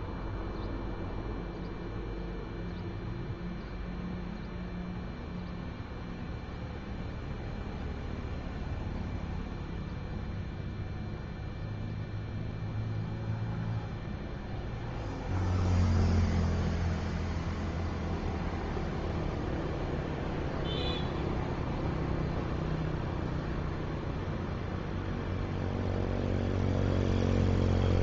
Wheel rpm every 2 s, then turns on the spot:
0, 0, 0, 0, 0, 0, 0, 0, 0, 0, 0, 0, 0, 0.
none